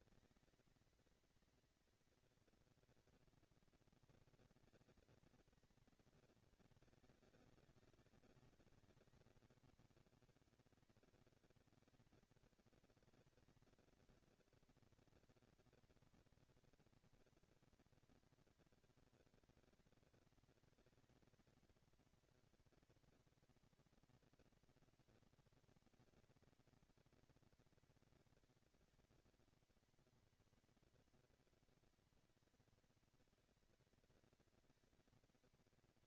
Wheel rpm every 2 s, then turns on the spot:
220, 230, 220, 210, 200, 210, 220, 230, 230, 230, 230, 230, 230, 230, 240, 230, 230, 230.
none